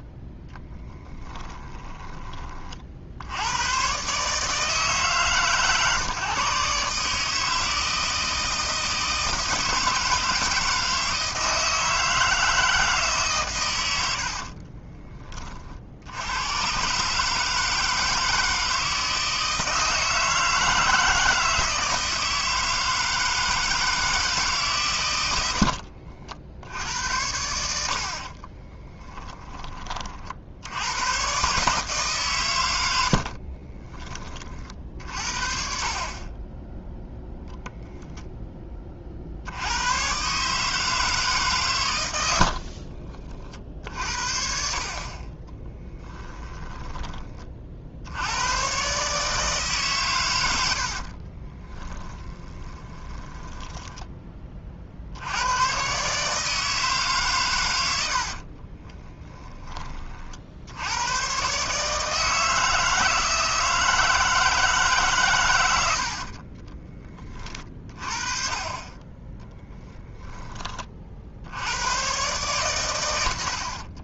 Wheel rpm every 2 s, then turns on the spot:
10, 50, 150, 140, 160, 160, 160, 40, 120, 160, 160, 160, 130, 70, 20, 80, 110, 50, 10, 30, 160, 60, 50, 20, 120, 70, 20, 50, 150, 30, 80, 160, 150, 30, 20, 40, 120.
0-2 14-16 28-30 42-44 50-54 58-60 66-68